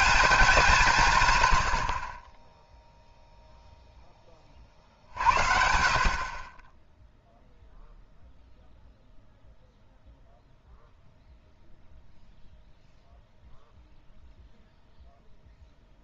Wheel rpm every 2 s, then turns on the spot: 190, 10, 30, 20, 0, 0, 0, 0.
none